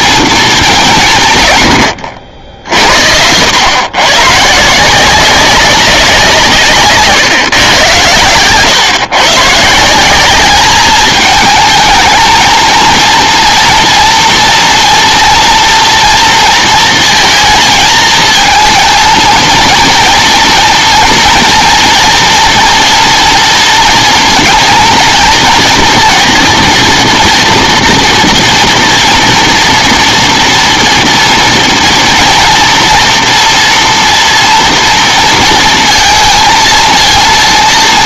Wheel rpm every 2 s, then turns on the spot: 190, 80, 170, 140, 130, 210, 230, 230, 230, 220, 230, 230, 230, 230, 230, 230, 230, 230, 230.
none